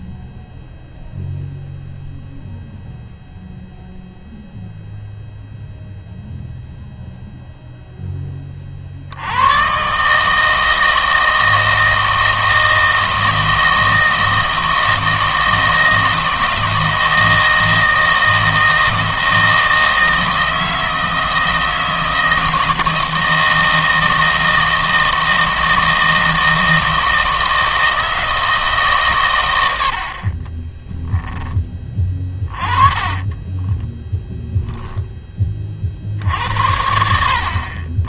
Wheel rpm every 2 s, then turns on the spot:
0, 0, 0, 0, 30, 160, 160, 160, 160, 160, 160, 160, 160, 160, 150, 10, 20, 0, 70.
30-34